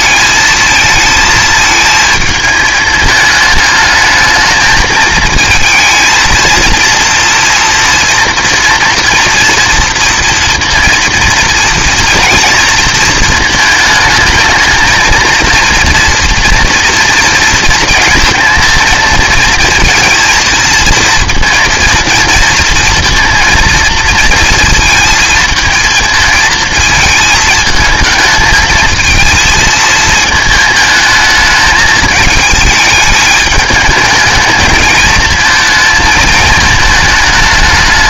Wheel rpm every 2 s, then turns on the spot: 220, 220, 220, 230, 230, 230, 230, 220, 230, 230, 230, 230, 230, 220, 220, 220, 220, 220, 220.
none